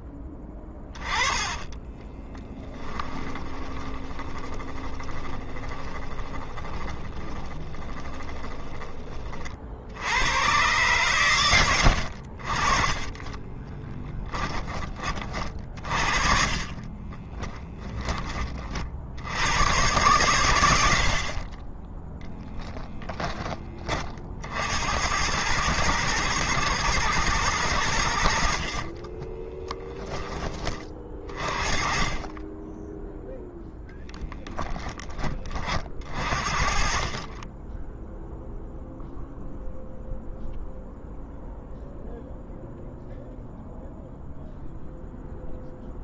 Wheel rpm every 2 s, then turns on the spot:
20, 10, 30, 20, 20, 120, 30, 30, 30, 40, 90, 10, 80, 110, 60, 30, 10, 10, 50, 0, 0, 0, 0.
0-8 16-18 28-30